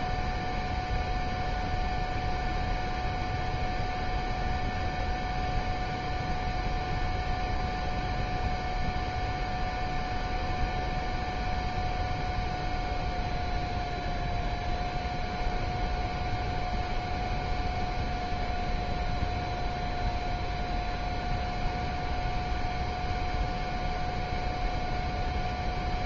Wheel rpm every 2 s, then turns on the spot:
0, 0, 0, 0, 0, 0, 0, 0, 0, 0, 0, 0, 0.
none